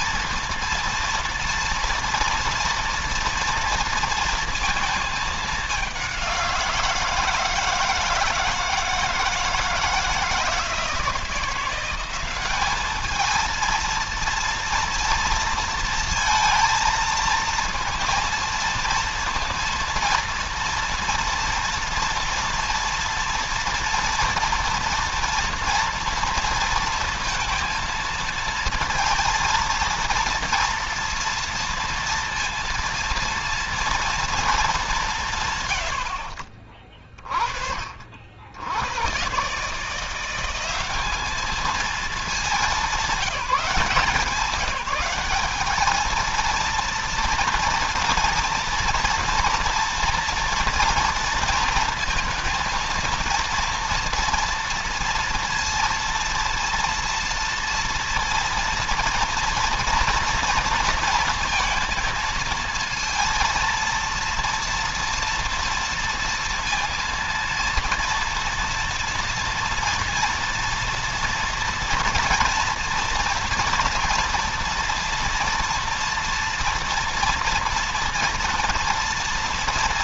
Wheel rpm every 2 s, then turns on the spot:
230, 230, 220, 170, 160, 160, 210, 230, 230, 230, 230, 230, 240, 230, 230, 230, 230, 180, 30, 100, 200, 200, 190, 230, 230, 230, 230, 230, 230, 230, 230, 230, 230, 230, 230, 230, 230, 230, 230, 230.
none